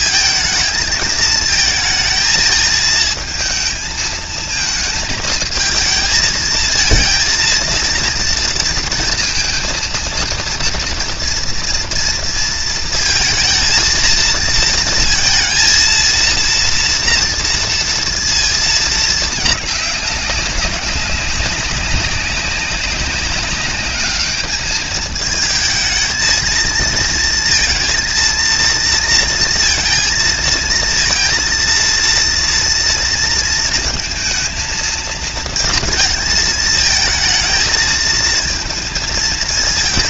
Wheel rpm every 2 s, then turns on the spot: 220, 220, 220, 230, 230, 230, 230, 230, 230, 230, 200, 200, 210, 220, 230, 230, 230, 230, 220, 220.
none